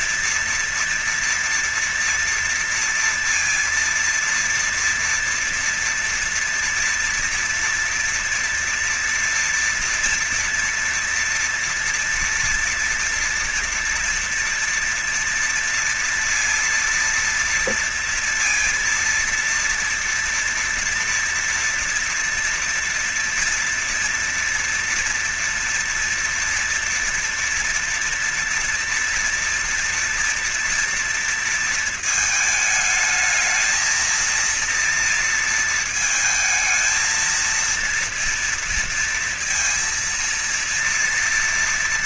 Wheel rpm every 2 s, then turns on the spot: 230, 230, 230, 230, 240, 230, 230, 230, 230, 230, 230, 230, 240, 230, 240, 230, 220, 220, 220, 230, 230.
none